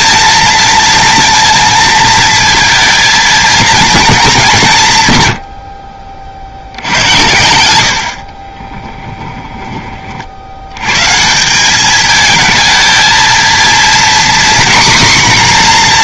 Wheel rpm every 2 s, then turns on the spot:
230, 230, 160, 70, 10, 100, 220, 250.
8-10